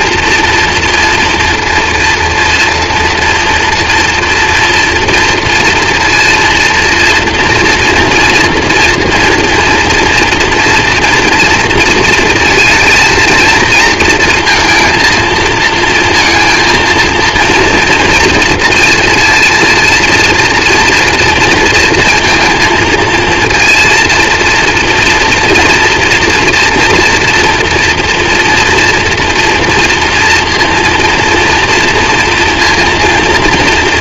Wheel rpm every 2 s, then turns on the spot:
230, 230, 240, 230, 230, 230, 230, 230, 230, 230, 230, 230, 230, 230, 230, 230, 230.
none